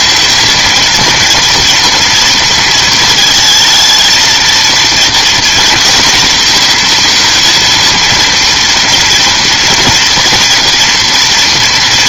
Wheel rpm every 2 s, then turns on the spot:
230, 220, 230, 240, 230, 230.
none